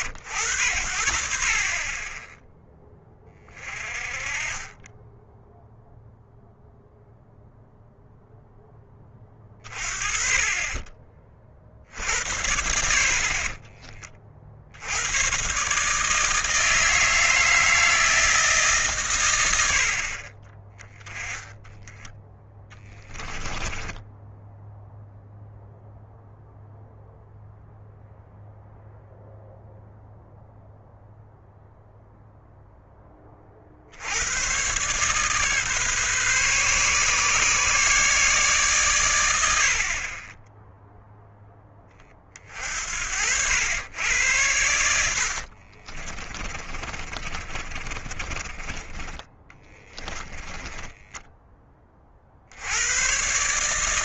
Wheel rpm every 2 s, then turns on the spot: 70, 10, 20, 0, 10, 20, 60, 90, 160, 140, 20, 10, 0, 0, 0, 0, 10, 140, 140, 130, 0, 60, 80, 30, 20, 10, 110.
22-24 46-52